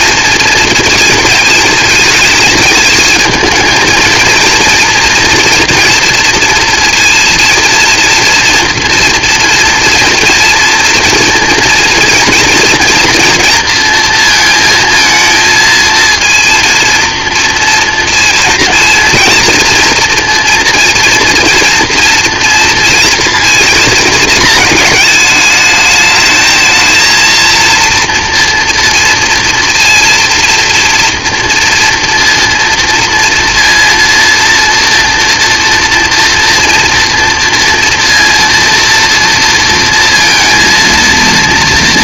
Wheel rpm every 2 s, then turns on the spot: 230, 220, 240, 230, 230, 240, 230, 220, 230, 230, 230, 230, 220, 220, 230, 230, 230, 230, 230, 230, 230.
none